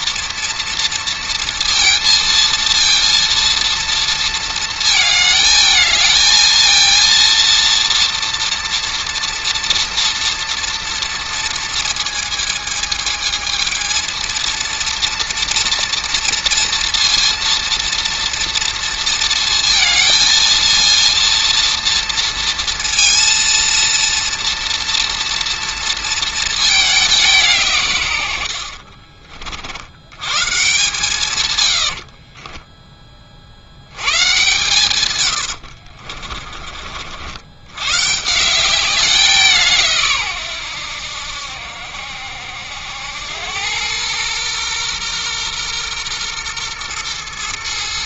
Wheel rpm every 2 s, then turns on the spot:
230, 230, 220, 230, 230, 230, 220, 230, 230, 230, 230, 230, 230, 210, 60, 150, 20, 110, 50, 190, 90, 90, 120, 120.
28-30